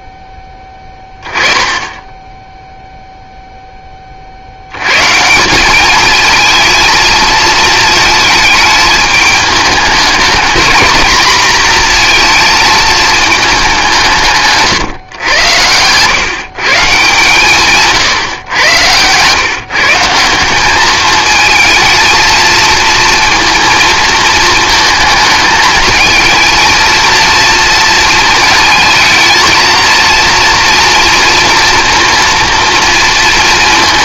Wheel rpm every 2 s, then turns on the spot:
10, 0, 100, 230, 220, 220, 230, 140, 140, 110, 200, 230, 220, 230, 220, 230, 230.
none